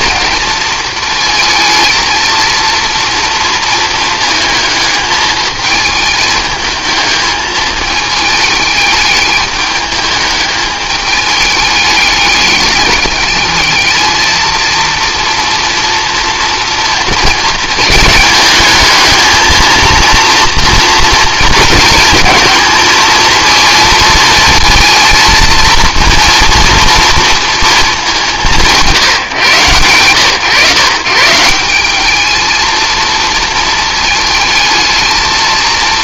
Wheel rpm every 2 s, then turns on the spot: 220, 230, 220, 220, 220, 210, 210, 230, 230, 220, 230, 230, 230, 230, 170, 130, 220, 220.
none